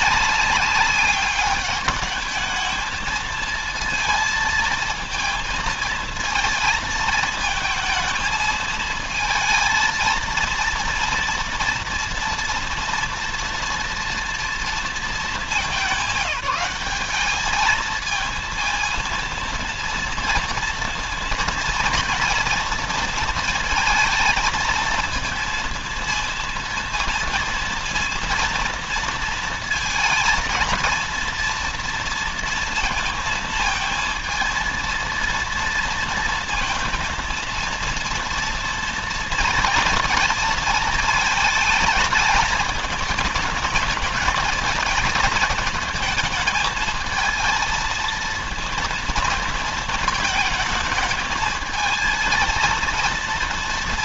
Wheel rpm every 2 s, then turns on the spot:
200, 220, 220, 220, 220, 230, 230, 230, 210, 230, 230, 230, 230, 230, 230, 230, 230, 230, 230, 230, 220, 220, 220, 220, 230, 220, 230.
none